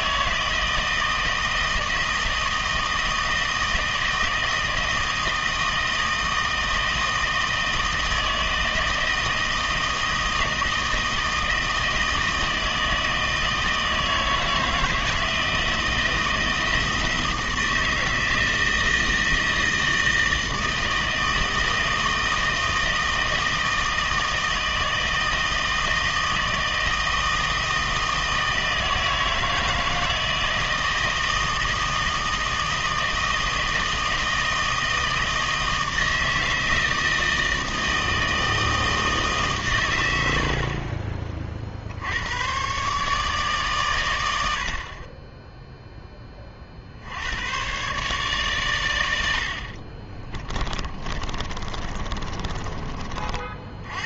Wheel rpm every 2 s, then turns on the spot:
160, 160, 160, 160, 160, 160, 160, 160, 160, 160, 160, 160, 160, 160, 160, 160, 160, 160, 160, 160, 60, 120, 70, 40, 120, 20, 30.
50-54